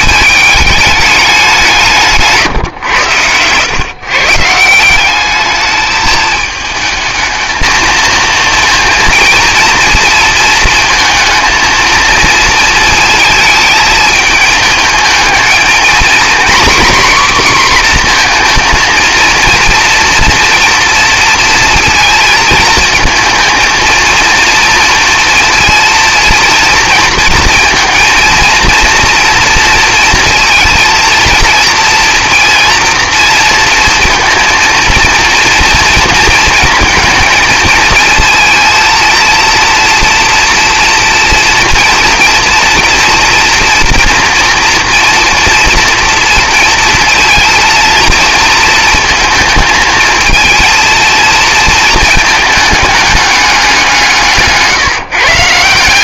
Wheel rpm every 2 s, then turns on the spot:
210, 130, 160, 220, 230, 230, 230, 220, 250, 230, 230, 220, 230, 230, 230, 230, 230, 230, 230, 230, 240, 230, 240, 230, 230, 230, 220, 160.
54-56